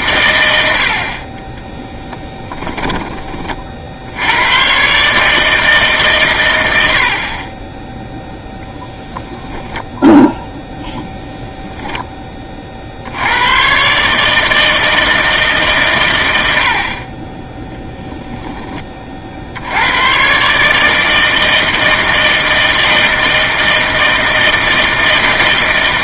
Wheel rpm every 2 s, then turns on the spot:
80, 10, 130, 80, 0, 0, 60, 160, 50, 20, 150, 160, 160.
none